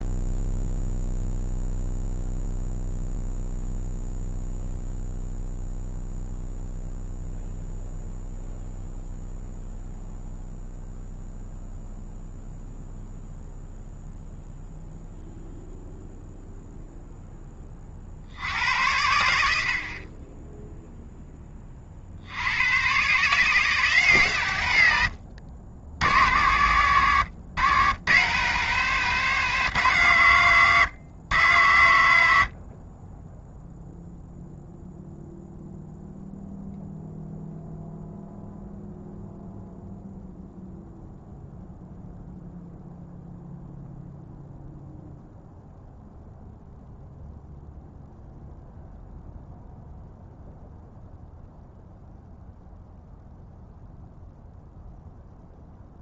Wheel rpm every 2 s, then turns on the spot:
0, 0, 0, 0, 0, 0, 0, 0, 0, 80, 0, 110, 110, 90, 150, 110, 30, 0, 0, 0, 0, 0, 0, 0, 0, 0, 0, 0.
none